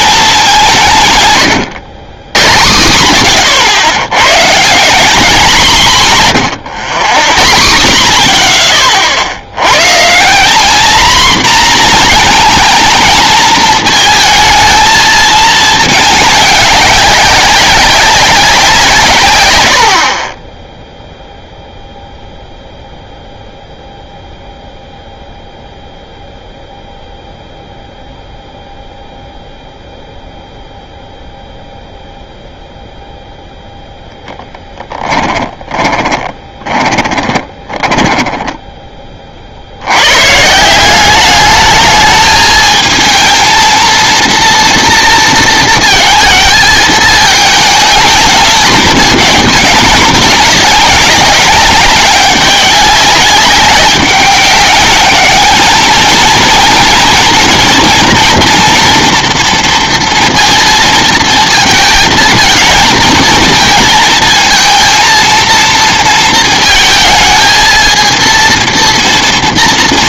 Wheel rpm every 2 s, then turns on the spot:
190, 100, 140, 140, 40, 200, 230, 220, 200, 190, 20, 0, 0, 0, 0, 0, 0, 10, 10, 10, 160, 220, 230, 220, 220, 210, 190, 200, 230, 230, 230, 220, 230, 230, 230.
36-40